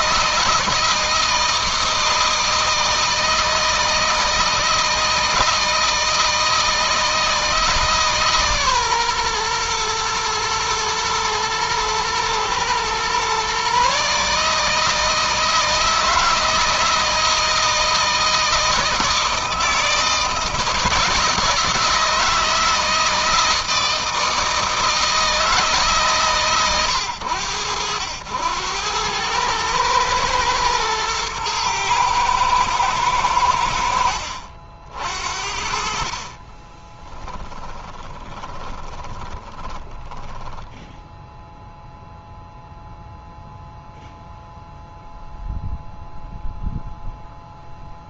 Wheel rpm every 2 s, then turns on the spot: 160, 160, 160, 160, 130, 110, 120, 160, 160, 160, 160, 160, 160, 100, 100, 110, 110, 60, 20, 20, 0, 0, 0, 0.
36-40